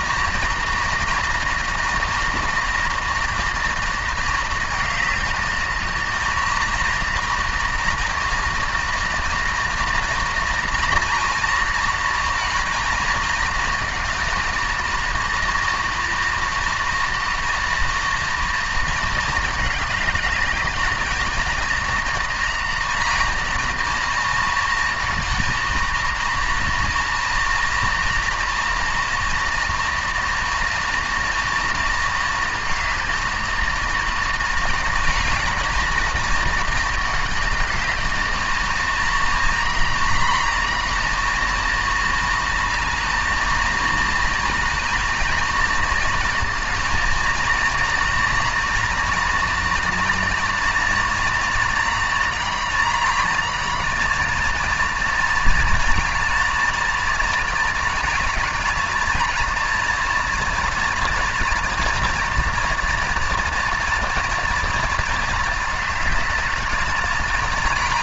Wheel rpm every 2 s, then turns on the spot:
230, 240, 220, 230, 230, 230, 220, 230, 230, 230, 220, 230, 230, 230, 230, 240, 230, 230, 220, 230, 240, 220, 230, 230, 230, 240, 230, 230, 220, 220, 230, 240, 230, 220.
none